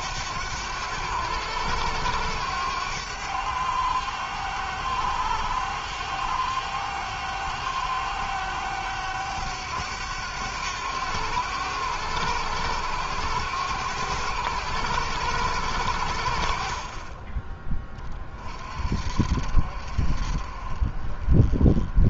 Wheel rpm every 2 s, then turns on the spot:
100, 100, 100, 100, 100, 100, 100, 100, 50, 50, 40.
none